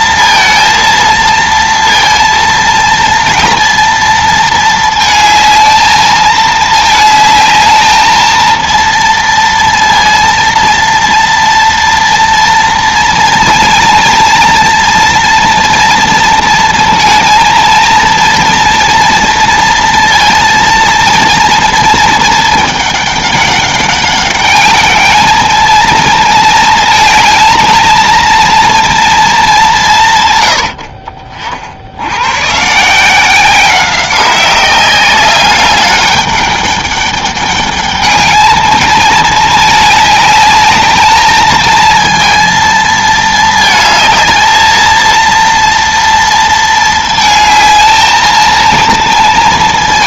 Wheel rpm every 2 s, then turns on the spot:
230, 230, 220, 220, 230, 230, 230, 230, 230, 230, 230, 220, 200, 220, 230, 100, 130, 190, 200, 220, 210, 230, 220, 230, 230.
none